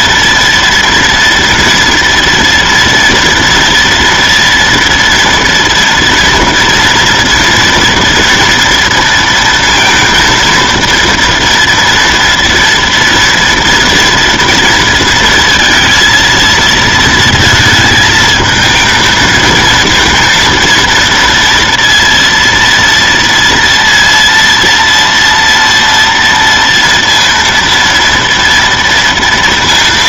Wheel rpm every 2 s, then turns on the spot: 230, 230, 230, 230, 230, 230, 230, 230, 230, 220, 230, 230, 230, 230, 230.
none